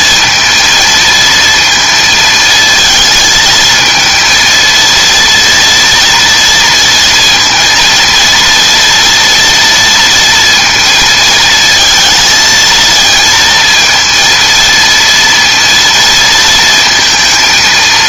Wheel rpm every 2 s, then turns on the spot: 230, 220, 230, 230, 230, 230, 220, 230, 230.
none